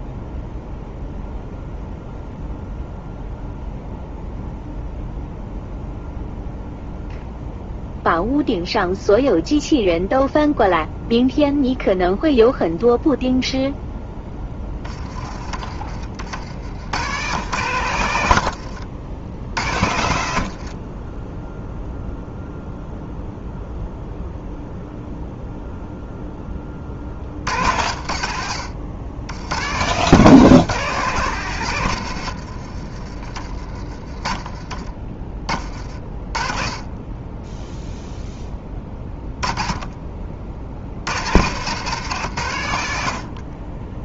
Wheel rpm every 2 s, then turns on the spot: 0, 0, 0, 0, 0, 0, 0, 20, 90, 80, 50, 0, 0, 30, 80, 150, 70, 30, 20, 20, 60, 110.
18-22 32-36 38-40